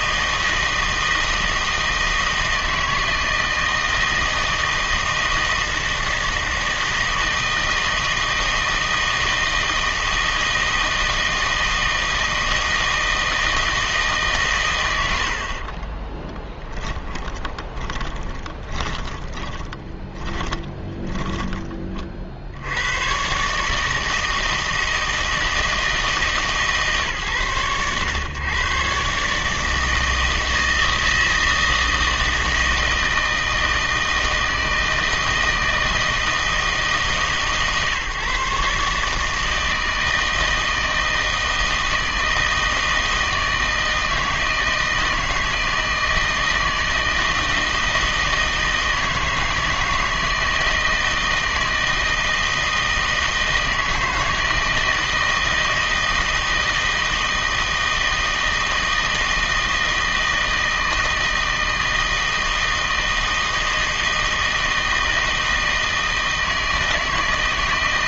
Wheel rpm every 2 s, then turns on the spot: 160, 160, 160, 160, 160, 160, 160, 110, 20, 20, 10, 80, 160, 150, 130, 160, 160, 160, 160, 140, 160, 160, 160, 160, 160, 160, 160, 160, 160, 160, 160, 160, 160, 160.
16-22